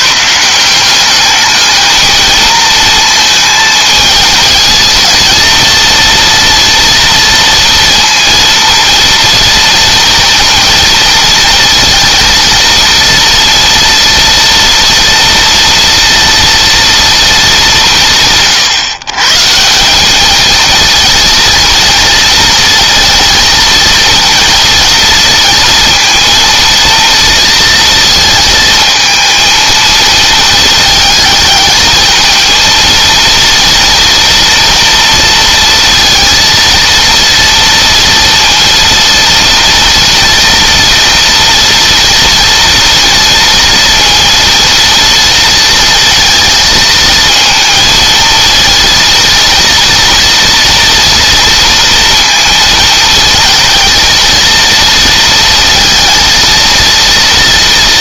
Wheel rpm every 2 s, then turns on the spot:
150, 220, 220, 230, 230, 230, 230, 230, 230, 160, 210, 230, 230, 230, 230, 220, 220, 230, 230, 230, 230, 230, 230, 230, 220, 230, 220, 230, 230.
none